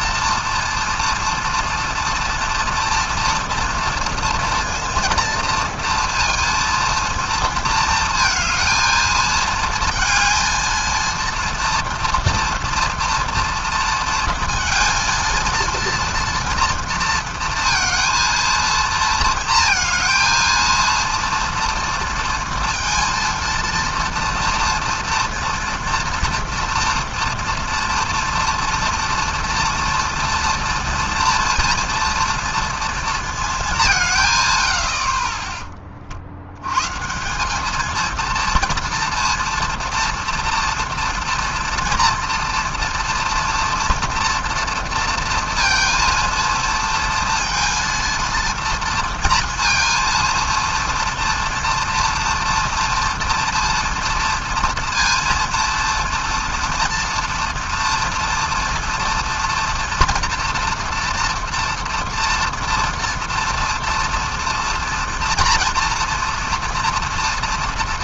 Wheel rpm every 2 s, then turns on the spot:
230, 230, 230, 230, 230, 230, 230, 230, 230, 230, 230, 230, 230, 230, 230, 230, 230, 70, 110, 230, 230, 230, 230, 230, 230, 230, 230, 230, 230, 230, 230, 230, 230, 230.
none